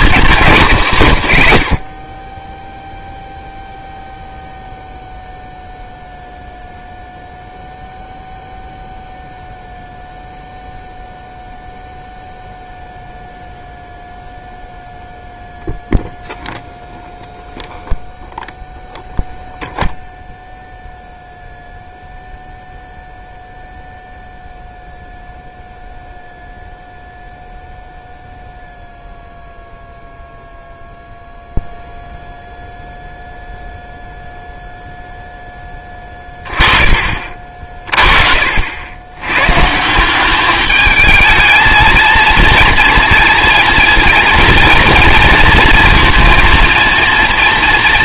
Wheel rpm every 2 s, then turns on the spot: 190, 10, 0, 0, 0, 0, 0, 0, 0, 0, 0, 0, 0, 0, 0, 0, 0, 0, 20, 60, 200, 230, 230, 230.
none